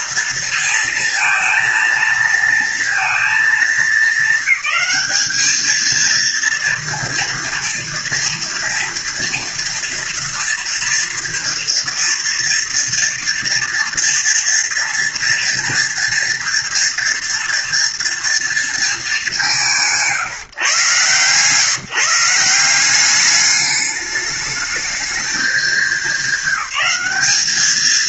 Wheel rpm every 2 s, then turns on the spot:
230, 230, 220, 230, 230, 230, 230, 240, 230, 230, 140, 170, 220, 200.
none